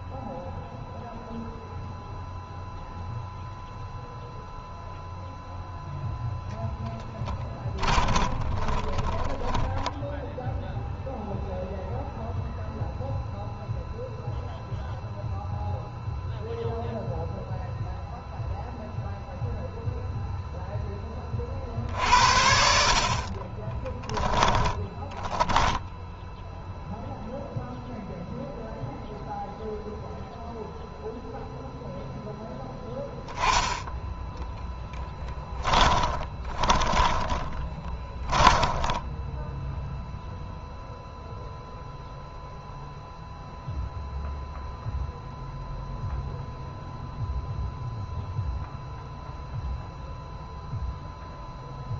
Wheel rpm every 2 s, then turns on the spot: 0, 0, 0, 10, 20, 0, 0, 0, 0, 0, 10, 50, 10, 0, 0, 0, 0, 10, 20, 10, 0, 0, 0, 0, 0, 0.
6-10 22-26 34-40